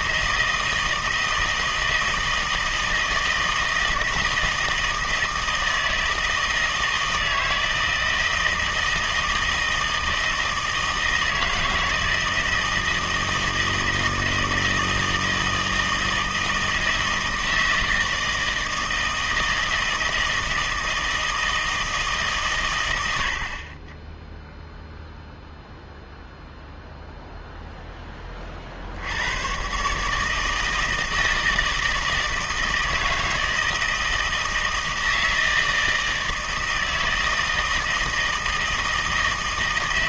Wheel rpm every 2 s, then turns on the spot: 160, 160, 160, 160, 160, 160, 160, 160, 160, 160, 160, 120, 0, 0, 50, 160, 160, 160, 160, 160.
none